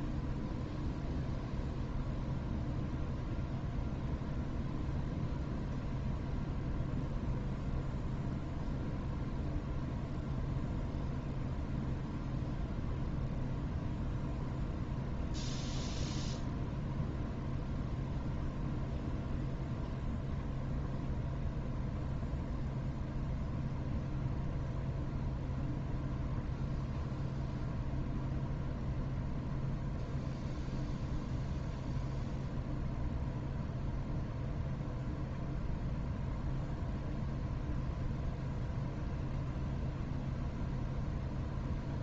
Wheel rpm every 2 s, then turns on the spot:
0, 0, 0, 0, 0, 0, 0, 0, 0, 0, 0, 0, 0, 0, 0, 0, 0, 0, 0, 0, 0.
none